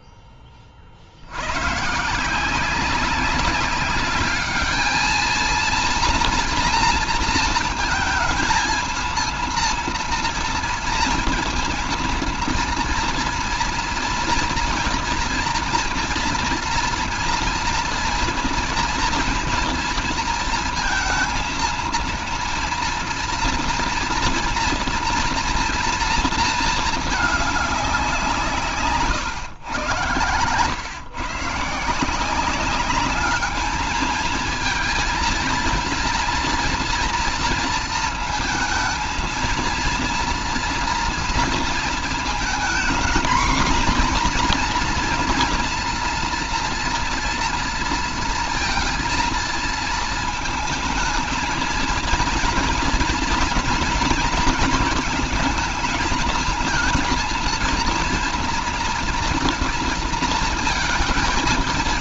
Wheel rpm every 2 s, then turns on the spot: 20, 170, 210, 230, 230, 230, 230, 230, 230, 230, 230, 230, 230, 230, 170, 110, 170, 220, 230, 220, 230, 230, 250, 230, 230, 220, 230, 230, 220, 230, 230.
none